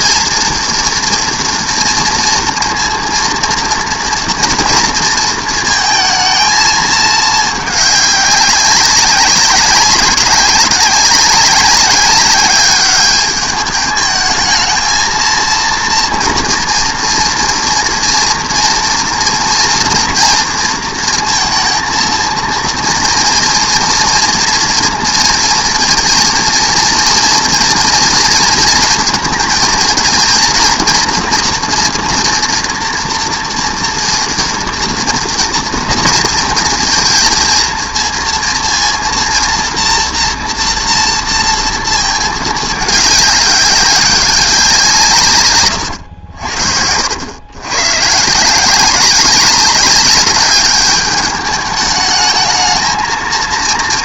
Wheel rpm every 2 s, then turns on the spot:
230, 230, 230, 220, 190, 190, 200, 220, 230, 230, 230, 230, 230, 230, 230, 230, 240, 230, 230, 230, 230, 210, 180, 70, 170, 200, 220.
none